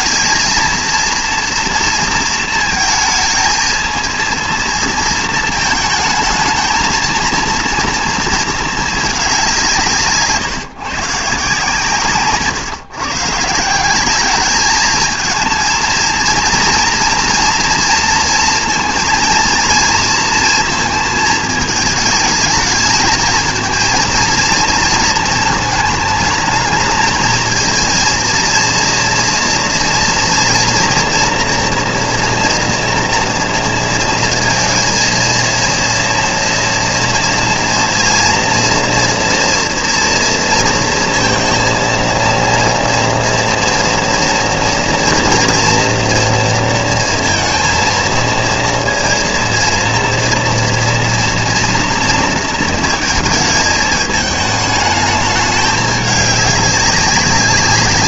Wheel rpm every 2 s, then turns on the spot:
220, 230, 230, 220, 220, 150, 140, 210, 230, 230, 230, 220, 230, 210, 230, 230, 240, 230, 240, 230, 230, 240, 230, 230, 230, 230, 230, 210, 200.
none